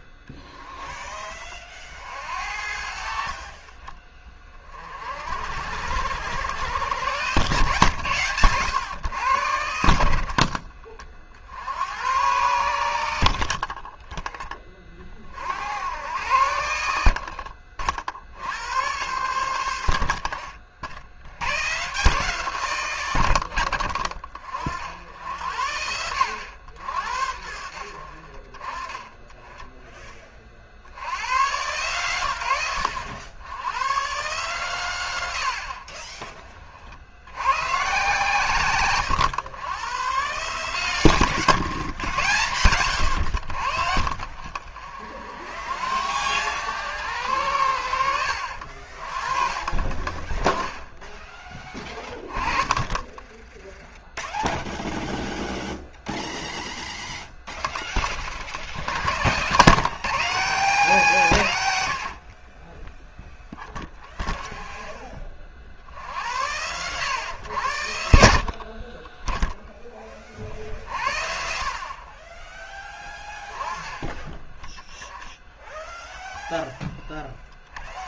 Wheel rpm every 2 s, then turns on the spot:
30, 60, 40, 110, 120, 40, 70, 30, 80, 100, 60, 130, 60, 90, 40, 50, 100, 130, 40, 120, 130, 110, 40, 100, 50, 10, 20, 0, 0, 60, 180, 20, 20, 100, 30, 50, 10, 20, 10.
none